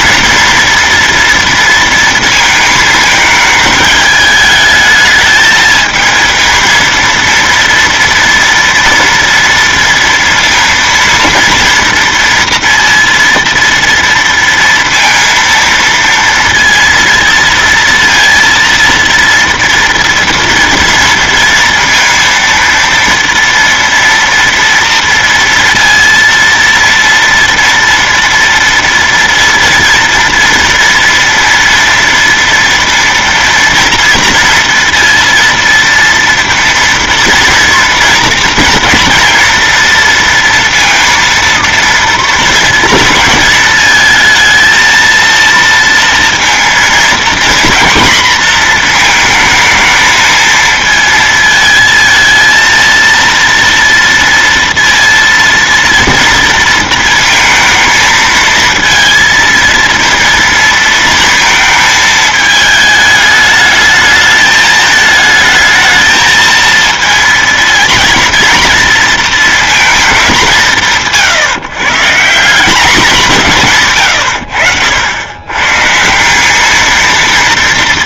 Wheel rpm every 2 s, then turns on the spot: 240, 230, 220, 220, 230, 230, 230, 230, 230, 230, 230, 230, 230, 230, 240, 230, 230, 230, 230, 230, 230, 230, 220, 230, 240, 220, 220, 230, 230, 230, 230, 220, 210, 220, 230, 190, 180, 100, 200.
none